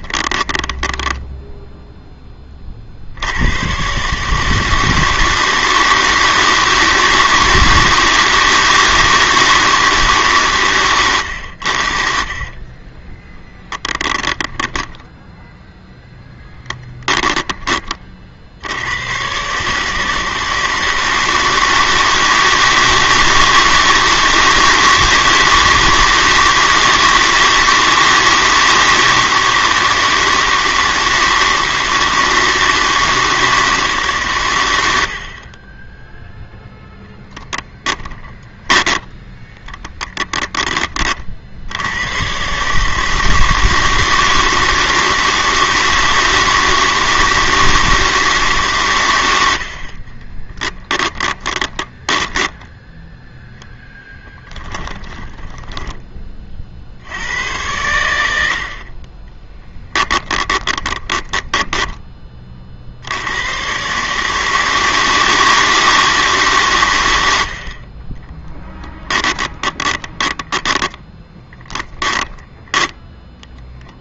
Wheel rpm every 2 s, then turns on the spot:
10, 70, 160, 160, 160, 110, 20, 10, 10, 100, 160, 160, 160, 160, 160, 160, 160, 80, 0, 10, 30, 160, 160, 160, 110, 10, 10, 20, 80, 30, 10, 80, 160, 120, 10, 20, 10.
14-18 38-40 50-52 54-56 60-62 68-74